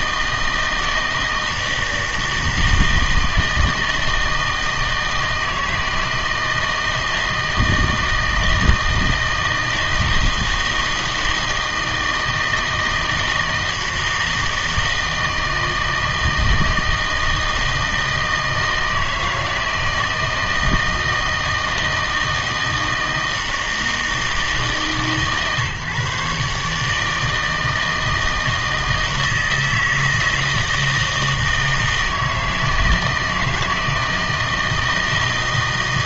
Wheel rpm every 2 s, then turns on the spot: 160, 160, 160, 160, 160, 160, 160, 160, 160, 160, 160, 160, 150, 140, 160, 160, 160, 160.
none